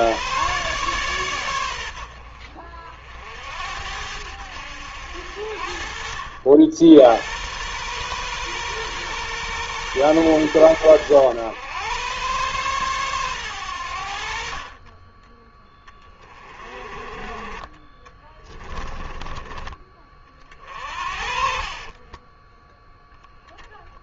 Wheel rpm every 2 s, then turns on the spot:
120, 60, 70, 80, 120, 100, 120, 40, 30, 20, 50, 0.
20-22